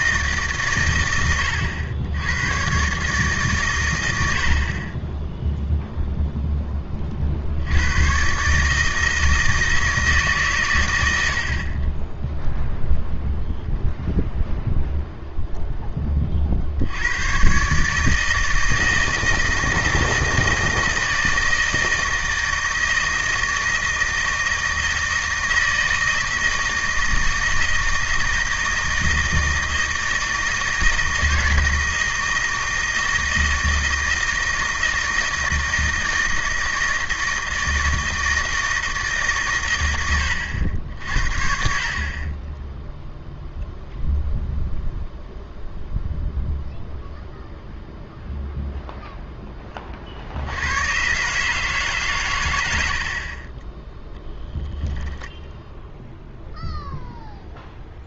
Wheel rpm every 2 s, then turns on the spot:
140, 120, 40, 10, 150, 130, 0, 0, 60, 160, 160, 160, 160, 160, 160, 160, 160, 160, 160, 160, 80, 10, 0, 0, 0, 90, 100, 10, 0.
none